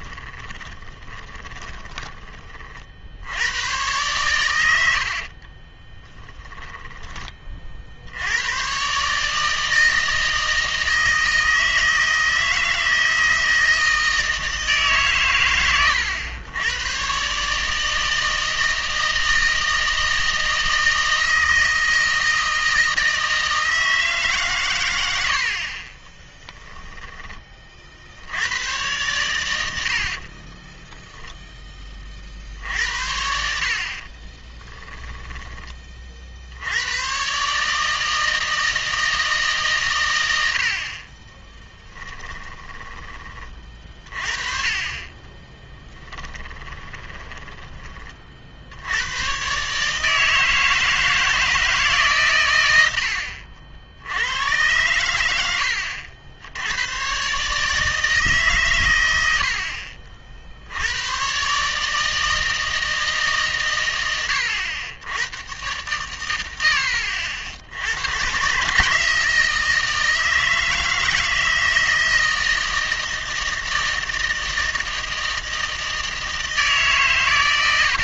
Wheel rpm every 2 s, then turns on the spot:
30, 40, 80, 10, 130, 160, 160, 150, 110, 160, 160, 160, 120, 10, 100, 10, 60, 10, 90, 160, 60, 20, 30, 20, 80, 160, 100, 100, 90, 120, 80, 160, 80, 90, 150, 160, 160, 160, 150.
0-2 6-8 26-28 30-32 34-36 42-44 46-48